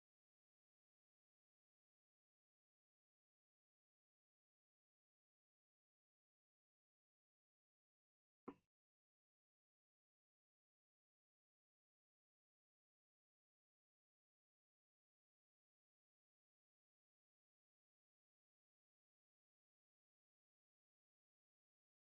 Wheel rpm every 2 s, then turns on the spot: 0, 0, 0, 0, 0, 0, 0, 0, 0, 0, 0.
none